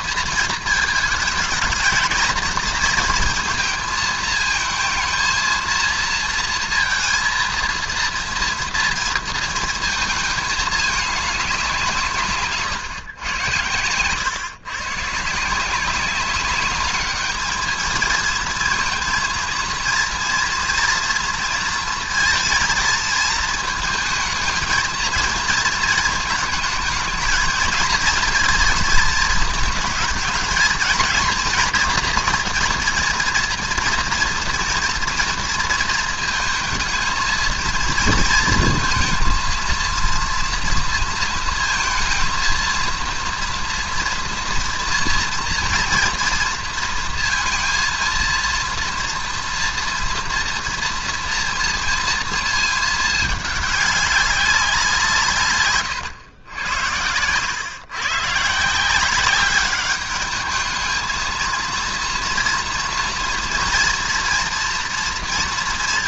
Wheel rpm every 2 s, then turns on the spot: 220, 220, 220, 230, 230, 210, 140, 130, 200, 220, 230, 230, 220, 220, 230, 230, 240, 230, 230, 230, 230, 230, 230, 230, 230, 230, 220, 190, 100, 150, 210, 230, 240.
12-14